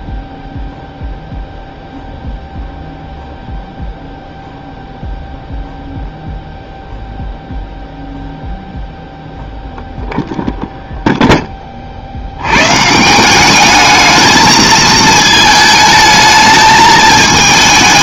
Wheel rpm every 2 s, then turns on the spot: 0, 0, 0, 0, 0, 0, 130, 220, 220.
none